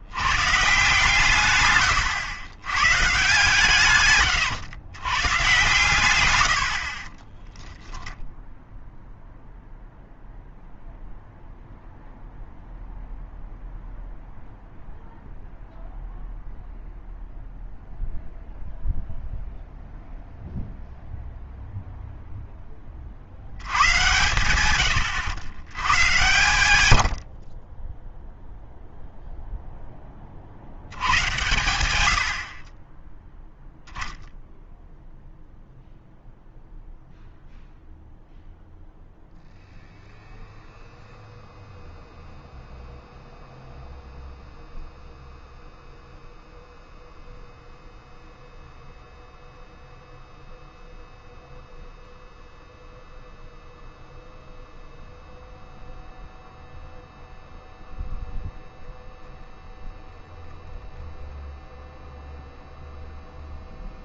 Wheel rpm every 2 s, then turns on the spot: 140, 130, 100, 80, 0, 0, 0, 0, 0, 0, 0, 20, 110, 100, 0, 70, 30, 0, 0, 0, 0, 0, 0, 0, 0, 0, 0, 0, 0, 0, 0, 0.
6-8